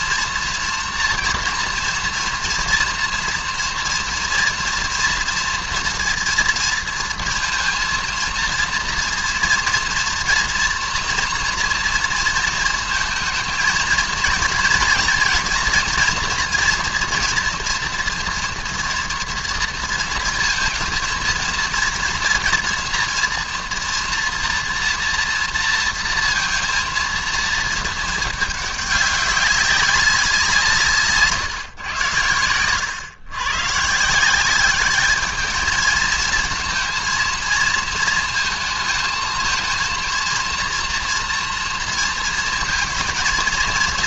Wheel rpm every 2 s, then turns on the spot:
230, 230, 230, 230, 230, 230, 230, 230, 230, 230, 230, 240, 230, 230, 210, 160, 110, 200, 230, 220, 230, 230.
none